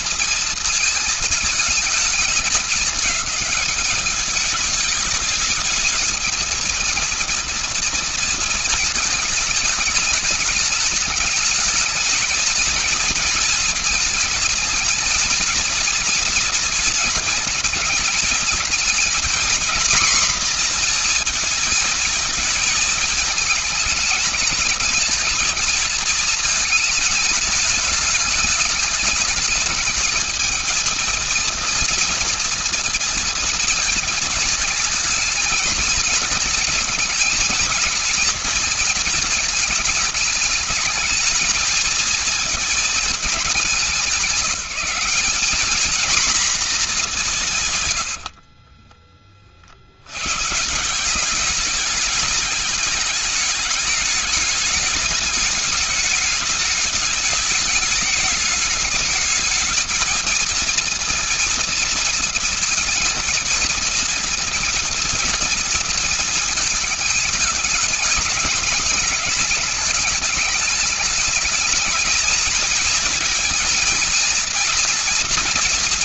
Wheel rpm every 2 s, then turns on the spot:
220, 220, 220, 230, 210, 220, 220, 230, 220, 250, 230, 220, 230, 210, 220, 230, 230, 220, 230, 220, 230, 200, 220, 90, 40, 200, 210, 210, 210, 220, 230, 230, 230, 210, 210, 210, 220, 230.
none